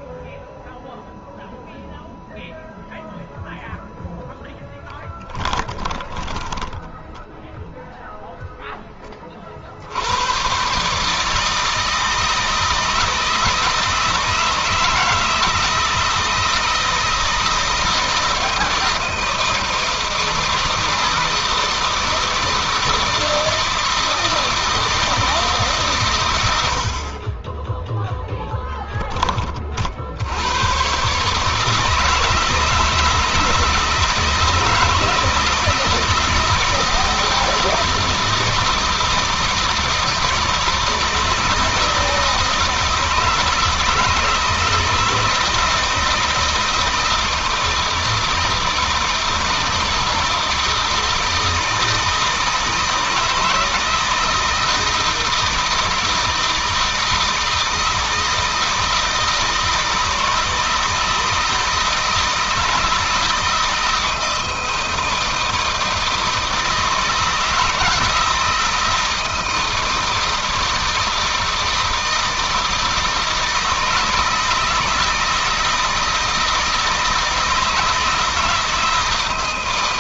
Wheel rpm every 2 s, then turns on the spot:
0, 0, 10, 10, 10, 140, 160, 160, 160, 160, 160, 160, 160, 70, 10, 130, 160, 160, 160, 160, 160, 160, 160, 160, 160, 160, 160, 160, 160, 160, 160, 160, 160, 160, 160, 160, 160, 160, 160, 160.
6-8